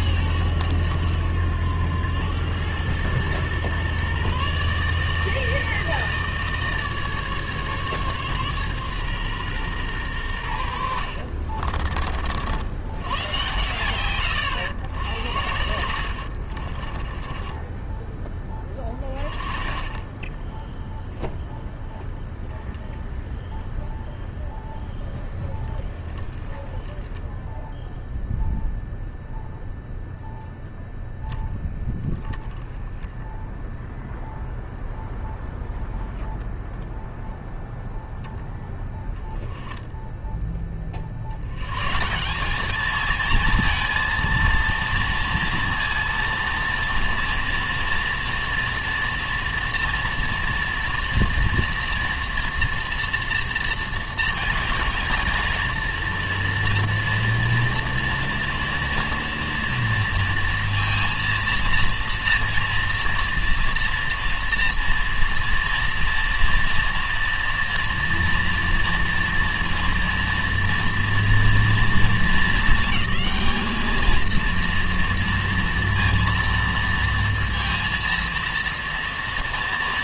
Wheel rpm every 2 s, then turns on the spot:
90, 120, 160, 150, 130, 70, 110, 70, 30, 20, 0, 0, 0, 10, 0, 10, 10, 0, 0, 0, 30, 210, 230, 230, 230, 230, 230, 230, 230, 230, 230, 230, 230, 230, 230, 230, 220, 230, 230, 230.
10-12 16-18